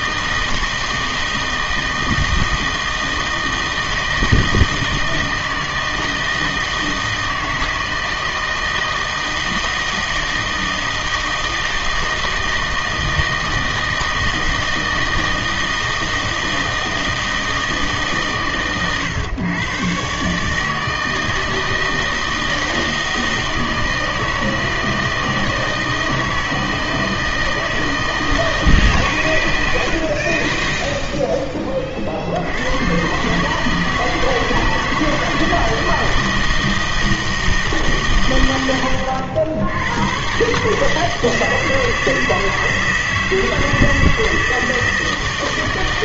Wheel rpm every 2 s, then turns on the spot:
160, 160, 160, 160, 160, 160, 160, 160, 160, 130, 150, 160, 160, 160, 150, 50, 90, 160, 160, 100, 140, 160, 160.
none